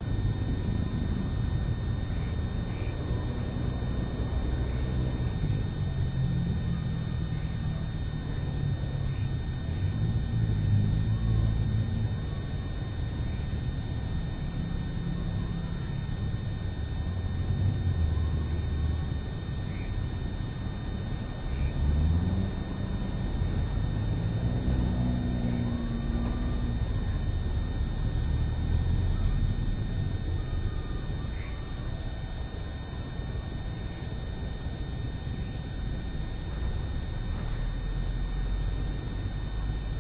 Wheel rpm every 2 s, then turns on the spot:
0, 0, 0, 0, 0, 0, 0, 0, 0, 0, 0, 0, 0, 0, 0, 0, 0, 0, 0, 0.
none